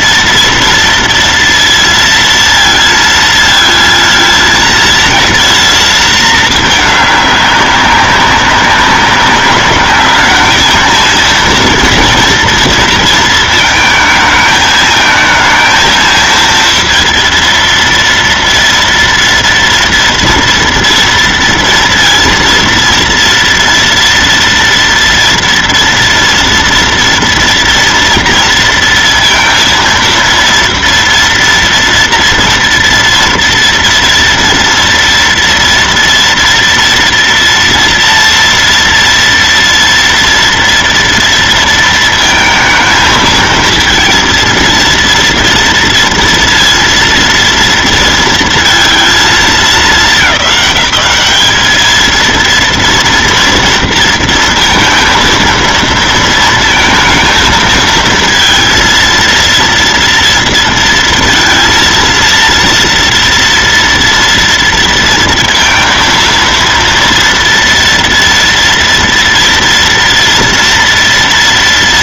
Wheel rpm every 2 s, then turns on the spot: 230, 230, 230, 200, 200, 230, 220, 220, 230, 230, 230, 230, 230, 230, 230, 230, 230, 240, 240, 230, 220, 230, 230, 230, 210, 220, 230, 230, 230, 230, 230, 230, 230, 230, 240, 230.
none